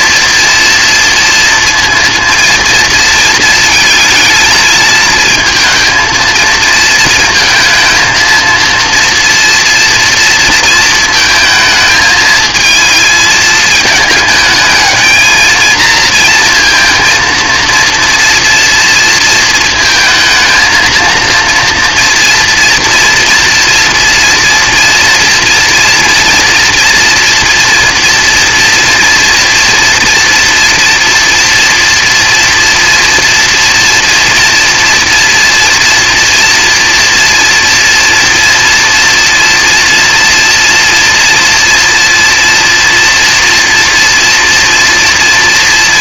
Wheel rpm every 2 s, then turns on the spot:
230, 230, 220, 230, 230, 230, 220, 210, 230, 230, 230, 240, 230, 230, 240, 230, 230, 230, 240, 230, 230, 230, 230.
none